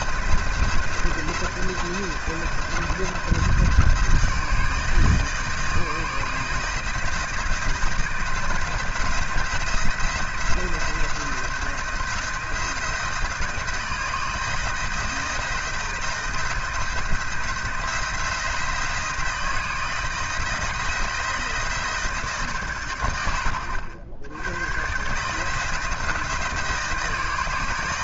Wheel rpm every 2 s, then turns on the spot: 170, 160, 160, 160, 170, 170, 160, 160, 160, 170, 160, 110, 120, 170.
none